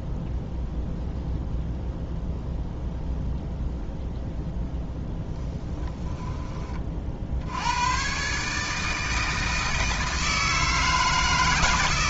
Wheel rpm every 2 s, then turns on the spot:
0, 0, 0, 30, 150, 160.
none